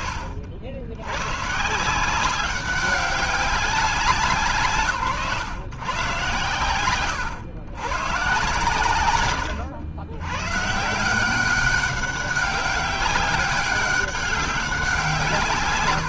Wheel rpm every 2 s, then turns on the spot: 70, 190, 130, 120, 120, 170, 200, 170.
none